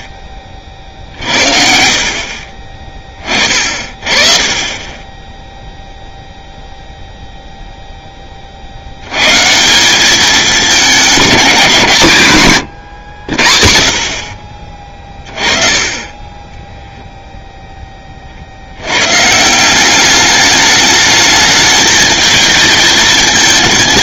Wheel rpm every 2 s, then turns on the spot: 50, 20, 20, 0, 70, 200, 120, 30, 10, 80, 210, 220.
0-2 12-14